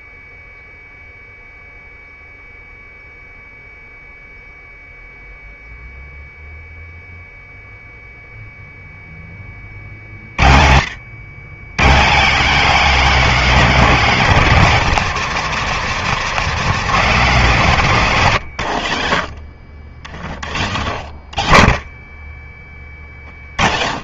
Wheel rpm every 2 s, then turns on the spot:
0, 0, 0, 0, 0, 90, 250, 210, 230, 110, 70, 30.
none